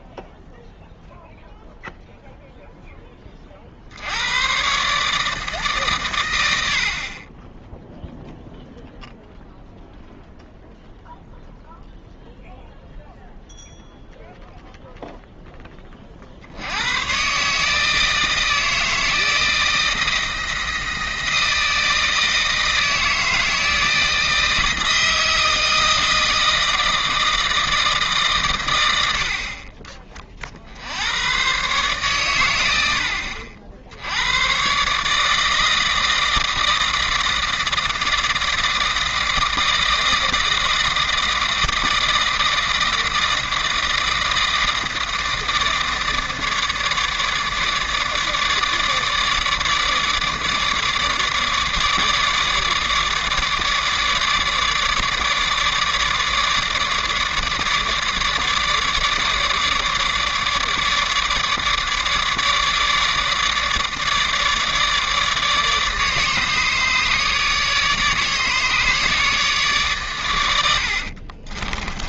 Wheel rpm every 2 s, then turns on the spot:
0, 10, 140, 60, 0, 0, 0, 0, 100, 160, 160, 160, 160, 160, 90, 80, 90, 140, 160, 160, 160, 160, 160, 150, 150, 150, 150, 150, 150, 150, 150, 150, 150, 150, 150, 70.
70-72